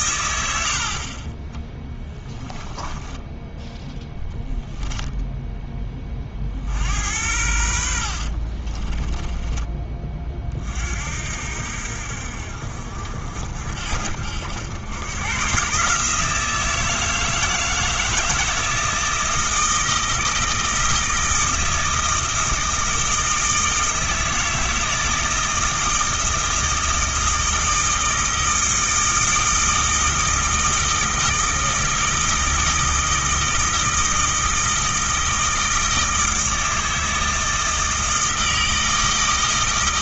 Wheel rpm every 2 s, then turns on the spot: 60, 10, 0, 70, 30, 50, 60, 90, 160, 160, 160, 160, 160, 160, 160, 160, 160, 160, 160, 160.
2-4 8-10